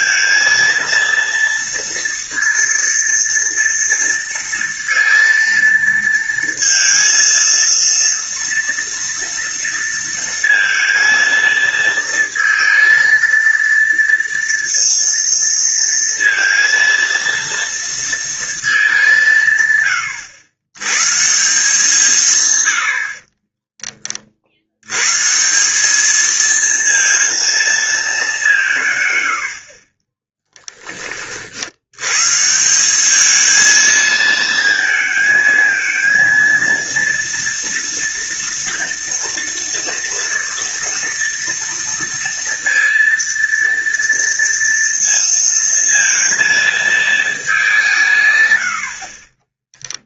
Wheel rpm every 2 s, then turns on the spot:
230, 230, 230, 230, 230, 230, 230, 230, 230, 220, 110, 120, 60, 220, 180, 20, 160, 220, 230, 230, 230, 230, 230, 230, 100.
30-32